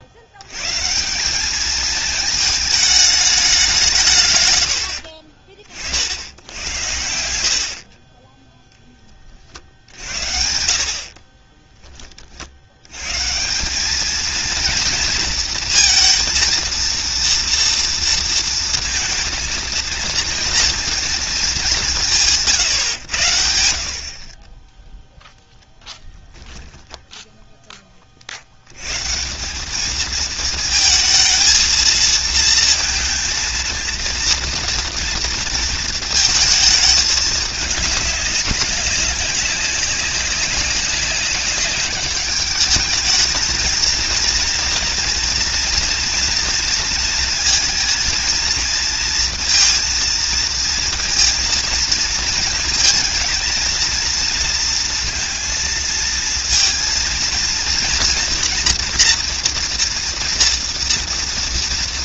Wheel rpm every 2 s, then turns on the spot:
130, 220, 100, 90, 10, 70, 70, 230, 230, 230, 230, 150, 10, 0, 80, 220, 230, 230, 220, 200, 190, 210, 230, 230, 230, 230, 220, 230, 230, 240, 230.
none